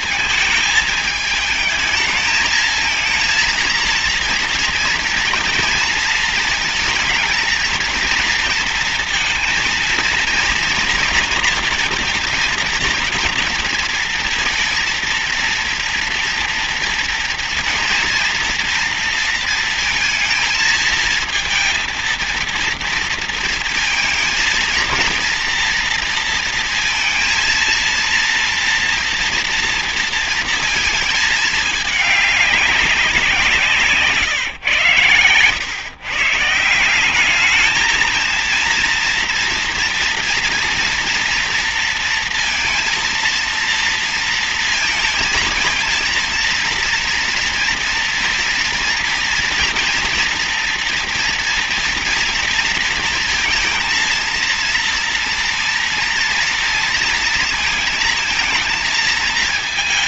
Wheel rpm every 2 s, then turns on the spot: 220, 220, 230, 220, 230, 230, 230, 230, 230, 230, 220, 230, 230, 230, 230, 230, 200, 140, 150, 230, 230, 230, 230, 230, 230, 230, 230, 230, 230, 230.
none